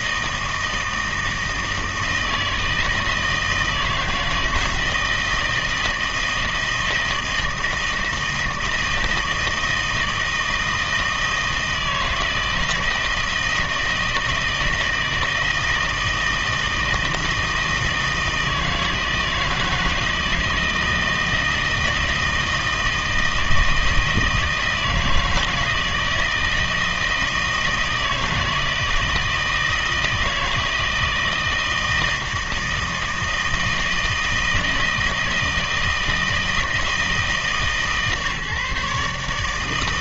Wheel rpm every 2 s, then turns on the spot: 160, 160, 160, 160, 160, 160, 160, 160, 160, 160, 160, 160, 160, 160, 160, 160, 160, 160, 160, 150.
none